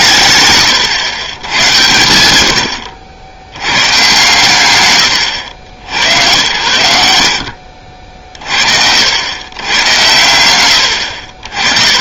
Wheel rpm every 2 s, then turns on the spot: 140, 70, 150, 90, 110, 100.
none